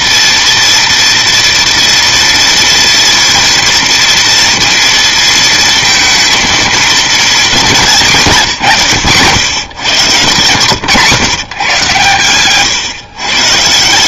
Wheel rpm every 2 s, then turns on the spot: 240, 230, 230, 230, 130, 110, 120.
none